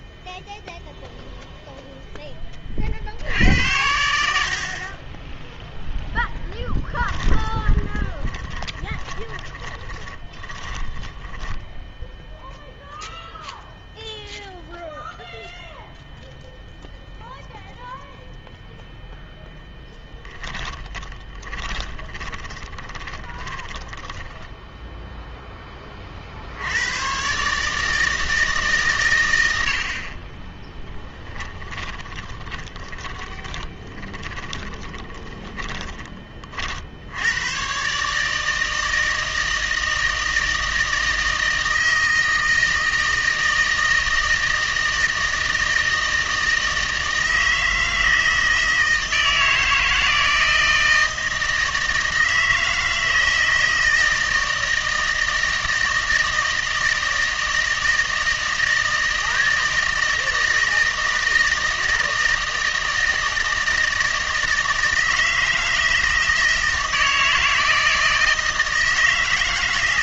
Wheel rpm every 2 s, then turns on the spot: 0, 40, 40, 10, 20, 20, 0, 0, 0, 0, 20, 20, 0, 90, 130, 10, 20, 20, 50, 160, 160, 160, 160, 160, 160, 160, 160, 160, 160, 160, 160, 160, 160, 160, 160.
6-12 20-24 32-36